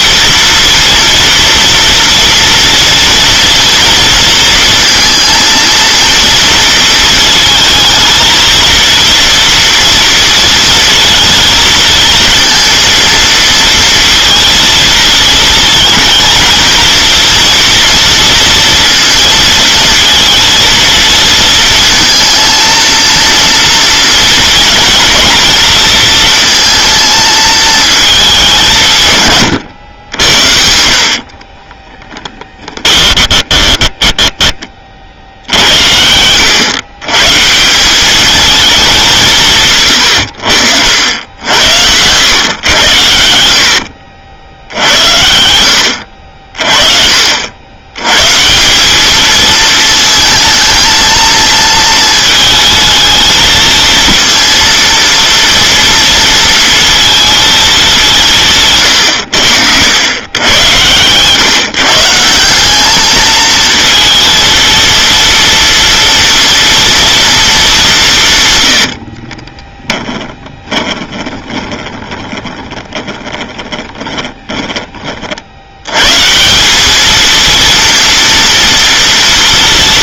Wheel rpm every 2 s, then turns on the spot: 230, 230, 230, 230, 220, 230, 230, 230, 230, 230, 230, 230, 230, 230, 200, 80, 10, 20, 100, 210, 80, 110, 70, 50, 150, 220, 220, 230, 230, 170, 100, 180, 230, 230, 140, 20, 20, 20, 160, 230.
30-34 70-76